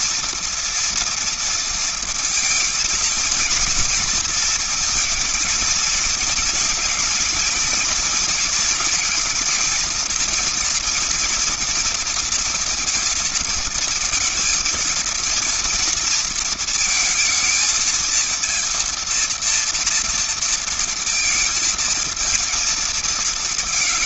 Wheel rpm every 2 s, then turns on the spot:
240, 230, 220, 230, 230, 230, 230, 230, 230, 230, 230, 220.
none